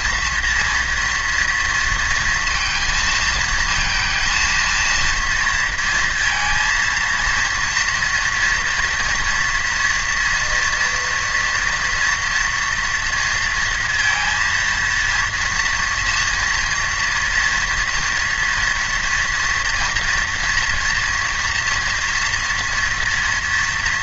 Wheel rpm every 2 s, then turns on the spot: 230, 230, 230, 230, 230, 230, 230, 230, 230, 230, 230, 230.
none